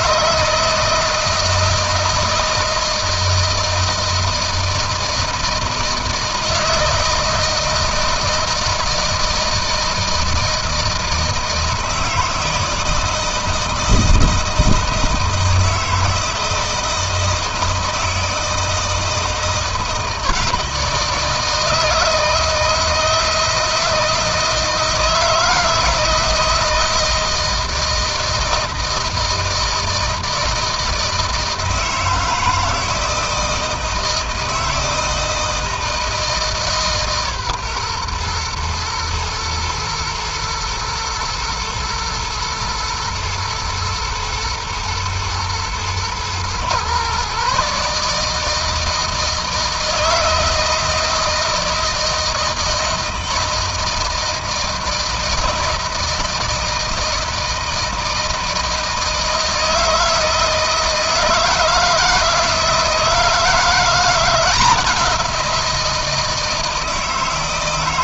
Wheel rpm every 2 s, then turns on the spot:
160, 160, 160, 160, 160, 160, 160, 160, 160, 160, 160, 160, 160, 160, 160, 160, 160, 160, 150, 120, 110, 110, 110, 120, 160, 160, 160, 160, 160, 160, 160, 160, 180, 160.
none